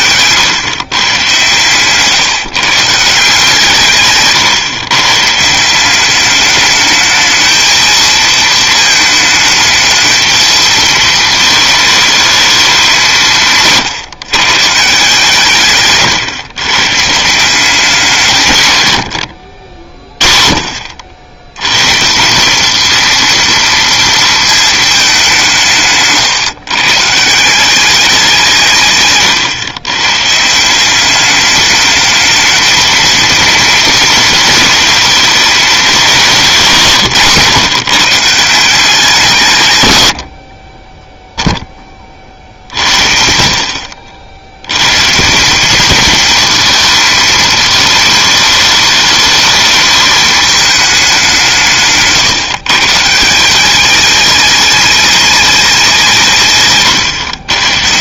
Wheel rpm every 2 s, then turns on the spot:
120, 140, 140, 210, 220, 220, 200, 150, 130, 120, 50, 210, 220, 140, 170, 170, 220, 230, 160, 160, 40, 50, 100, 220, 210, 210, 140, 210, 130.
none